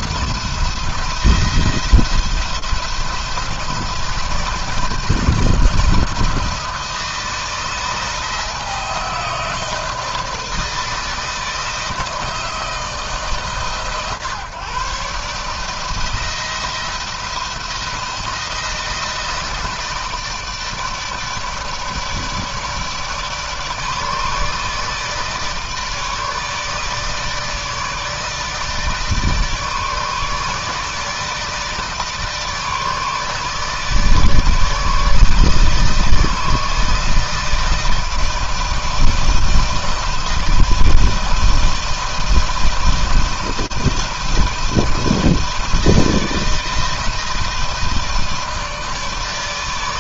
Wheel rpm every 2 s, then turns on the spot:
170, 170, 160, 160, 160, 160, 160, 140, 170, 160, 150, 150, 160, 150, 160, 160, 160, 160, 160, 160, 160, 160, 160, 160, 160.
none